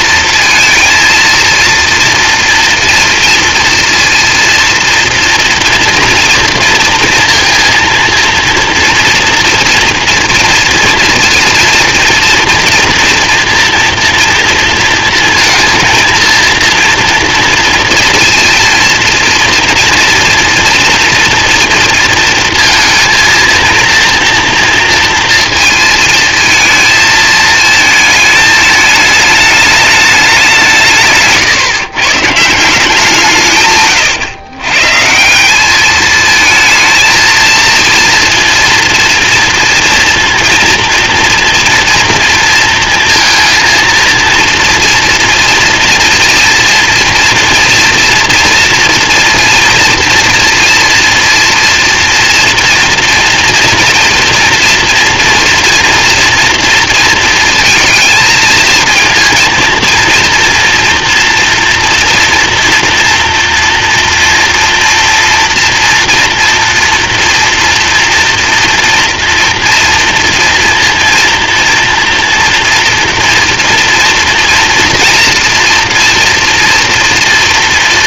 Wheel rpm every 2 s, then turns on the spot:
230, 230, 230, 230, 230, 230, 230, 230, 230, 230, 230, 230, 230, 220, 220, 180, 170, 120, 230, 230, 230, 230, 230, 230, 230, 230, 240, 230, 230, 220, 240, 230, 230, 230, 230, 230, 230, 230, 230.
none